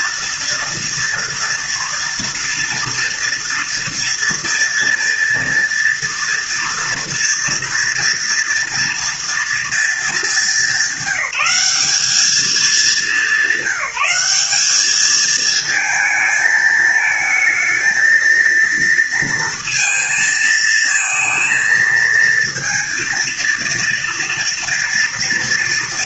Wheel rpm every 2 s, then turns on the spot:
230, 230, 230, 230, 230, 200, 210, 210, 220, 230, 230, 230, 230.
none